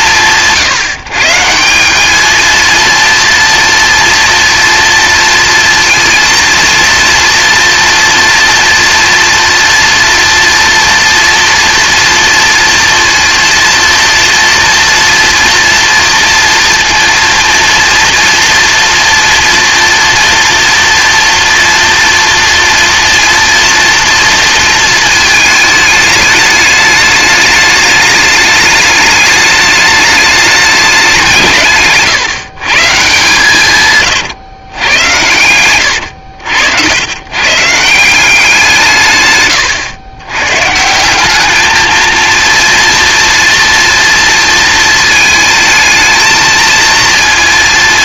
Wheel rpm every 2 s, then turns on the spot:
150, 230, 230, 230, 230, 230, 230, 230, 240, 230, 230, 230, 230, 210, 210, 200, 150, 110, 100, 150, 160, 230, 220, 230.
none